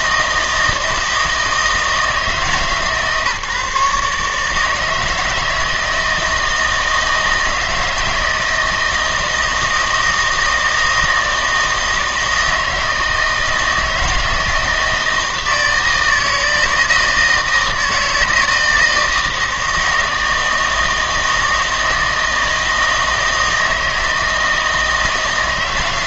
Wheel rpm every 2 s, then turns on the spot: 160, 150, 150, 160, 160, 160, 160, 160, 160, 160, 160, 160, 160.
none